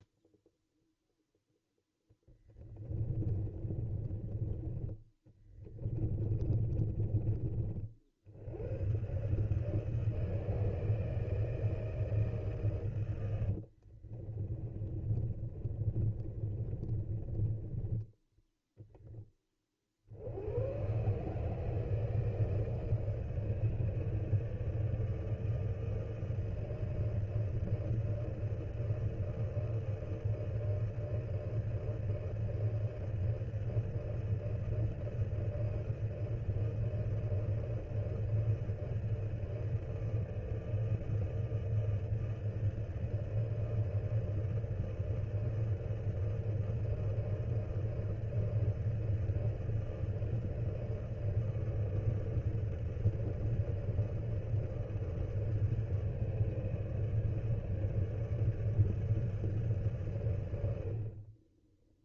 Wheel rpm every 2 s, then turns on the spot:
0, 20, 20, 20, 100, 160, 140, 30, 30, 10, 120, 160, 160, 160, 160, 160, 160, 160, 160, 160, 160, 160, 160, 160, 160, 160, 160, 150, 150, 150, 70.
2-4 6-8 14-18